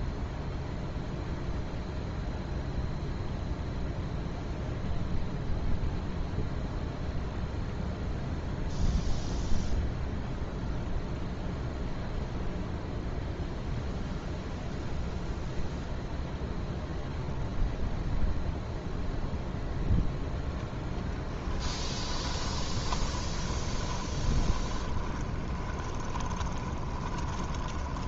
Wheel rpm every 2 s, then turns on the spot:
0, 0, 0, 0, 0, 0, 0, 0, 0, 0, 10, 30, 20, 20.
22-28